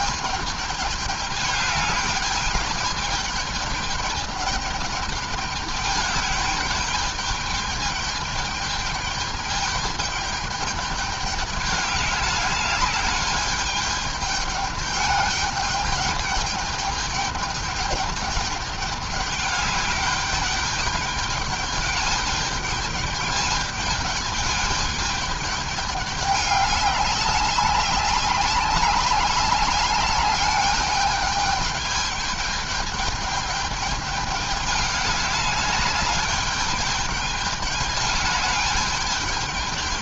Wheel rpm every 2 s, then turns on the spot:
210, 210, 210, 210, 210, 210, 200, 210, 210, 210, 200, 210, 210, 200, 200, 210, 210, 200, 210, 210.
none